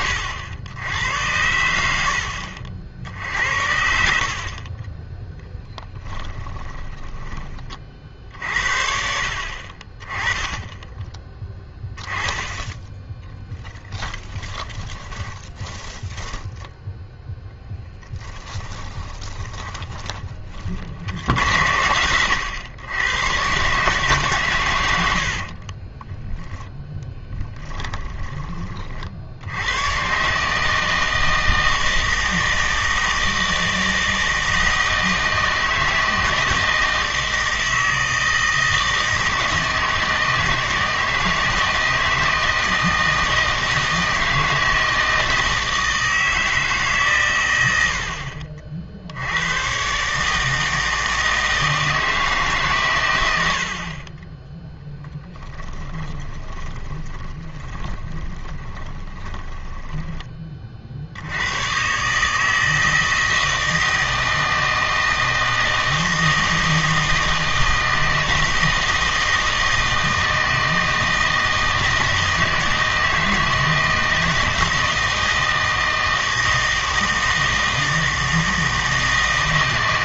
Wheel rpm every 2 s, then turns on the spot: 80, 60, 30, 20, 60, 10, 10, 10, 10, 20, 50, 100, 110, 10, 30, 160, 160, 160, 160, 160, 160, 160, 160, 150, 60, 160, 130, 0, 20, 20, 60, 160, 160, 160, 160, 160, 160, 160, 160, 160.
4-8 14-20 26-28 56-60